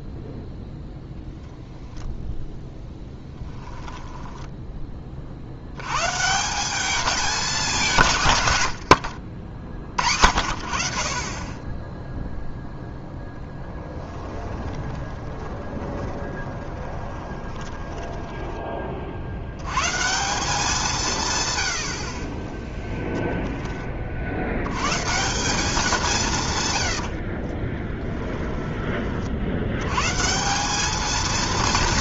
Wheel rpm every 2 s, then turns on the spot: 0, 10, 10, 190, 80, 50, 0, 20, 20, 20, 180, 30, 100, 120, 20, 200.
8-10 14-18 22-24 26-28